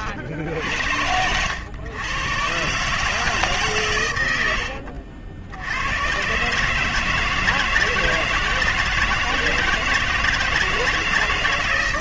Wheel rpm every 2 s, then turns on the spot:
70, 130, 60, 140, 160, 160.
none